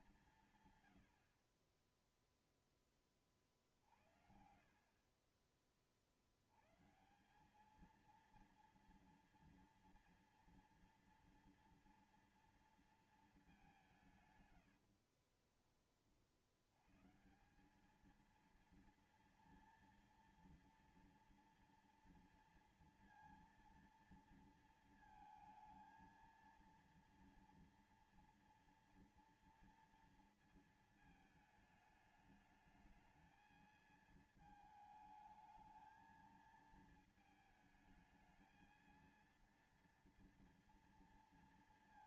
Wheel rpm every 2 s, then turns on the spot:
160, 10, 70, 80, 230, 230, 230, 140, 50, 220, 230, 230, 230, 230, 230, 230, 210, 220, 220, 220, 230.
14-16